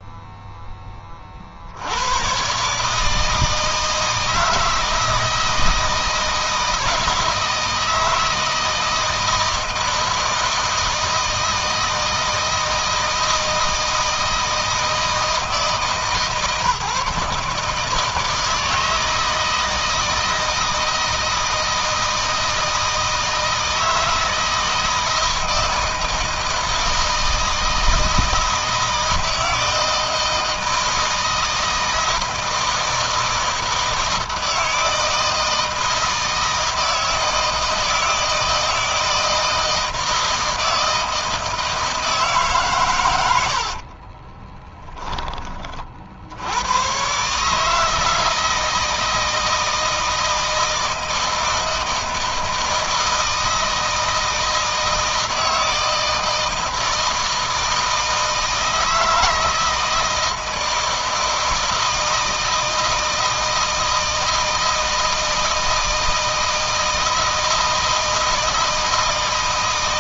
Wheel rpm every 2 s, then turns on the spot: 20, 150, 160, 160, 160, 160, 160, 160, 150, 160, 160, 160, 160, 160, 160, 160, 170, 160, 160, 160, 160, 100, 10, 120, 160, 160, 160, 160, 160, 160, 160, 160, 160, 160, 160.
42-44